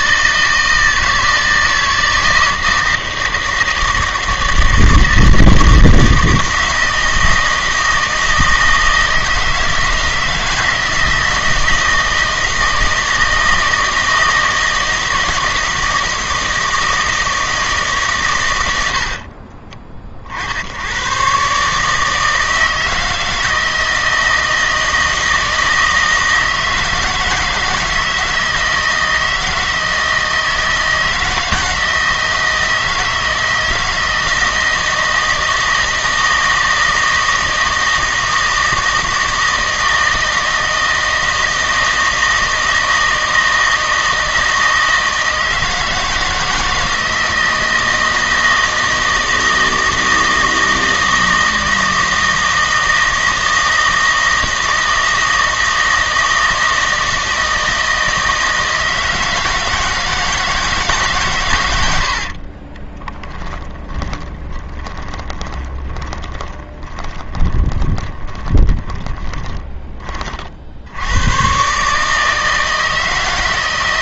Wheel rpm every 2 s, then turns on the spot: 160, 160, 160, 160, 160, 160, 160, 160, 160, 90, 80, 160, 160, 160, 160, 160, 160, 160, 160, 160, 160, 160, 160, 160, 160, 160, 160, 160, 160, 160, 160, 30, 20, 10, 10, 70, 160.
62-70